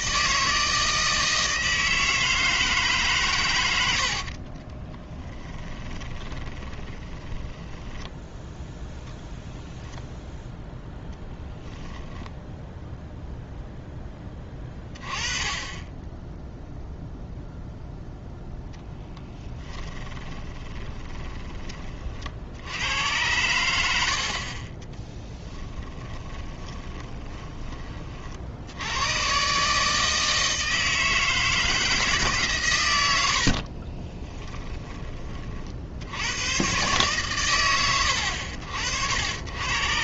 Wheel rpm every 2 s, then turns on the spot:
160, 150, 30, 20, 10, 0, 0, 20, 0, 0, 20, 90, 20, 20, 90, 160, 110, 20, 120, 70.
4-8 20-22 26-28